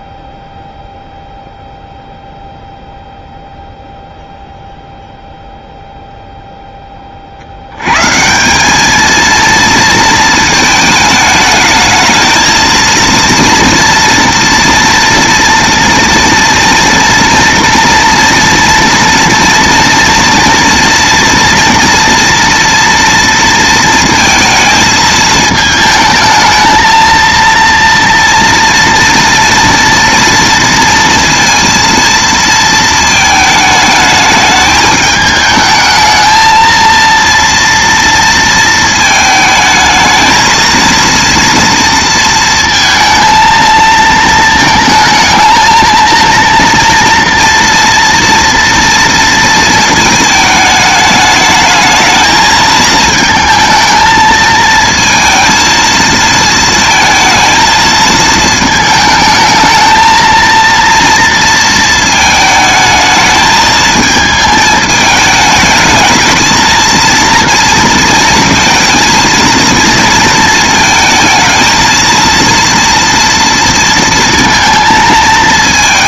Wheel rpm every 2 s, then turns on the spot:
0, 0, 0, 10, 210, 220, 220, 230, 230, 230, 230, 230, 220, 220, 230, 230, 230, 210, 220, 230, 230, 230, 220, 230, 230, 210, 220, 220, 220, 220, 230, 220, 220, 230, 220, 230, 230, 230.
none